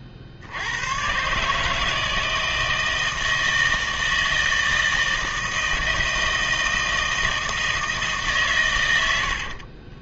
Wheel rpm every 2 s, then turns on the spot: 100, 160, 160, 160, 120.
none